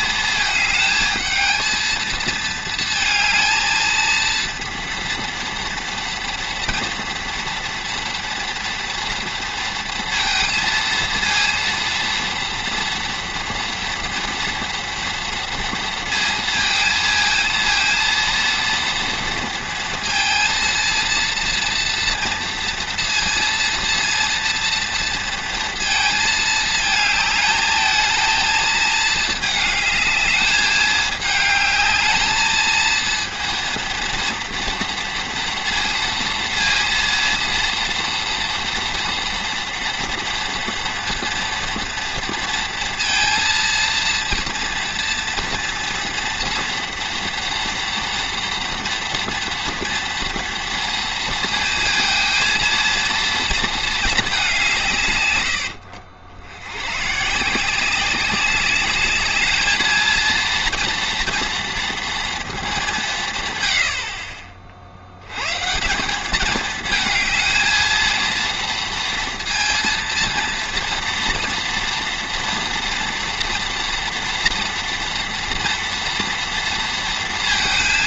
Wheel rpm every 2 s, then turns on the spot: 220, 220, 230, 230, 230, 230, 230, 230, 230, 230, 230, 230, 230, 220, 220, 210, 230, 230, 230, 240, 230, 230, 230, 230, 230, 230, 230, 150, 110, 200, 230, 200, 60, 220, 230, 230, 230, 230, 230.
none